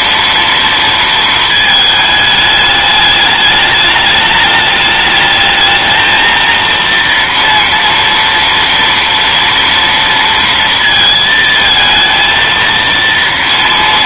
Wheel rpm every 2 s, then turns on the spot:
230, 210, 210, 230, 230, 230, 230.
none